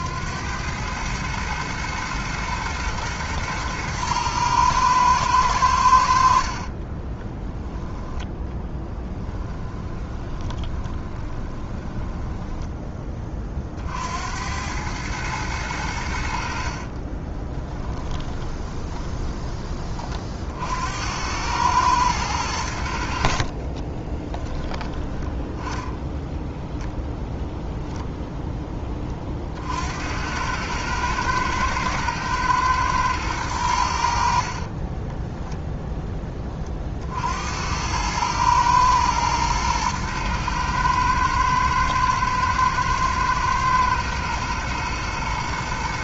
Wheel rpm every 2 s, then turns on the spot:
100, 110, 110, 40, 10, 20, 10, 100, 40, 20, 70, 80, 10, 0, 20, 110, 110, 30, 40, 110, 110, 110, 110.
6-12 16-20 34-36